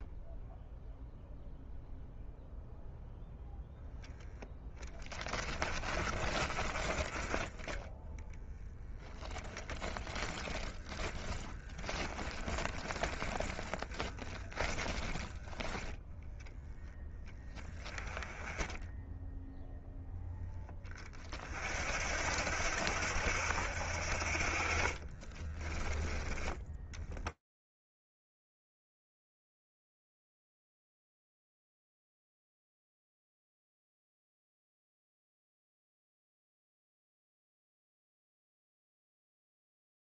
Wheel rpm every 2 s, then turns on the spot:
0, 0, 20, 20, 0, 20, 10, 10, 10, 10, 30, 70, 30, 20, 70, 100, 100, 110, 100, 90.
4-8 10-14 24-26